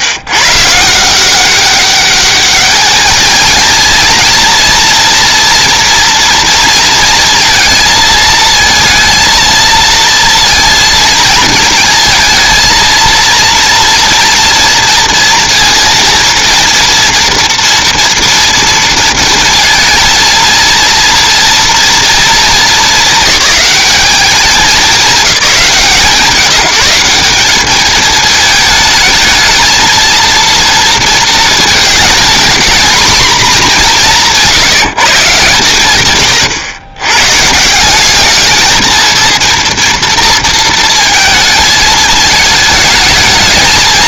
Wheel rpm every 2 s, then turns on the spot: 160, 210, 230, 230, 230, 230, 230, 230, 230, 230, 230, 210, 190, 170, 220, 230, 240, 160, 120, 230, 230, 210.
none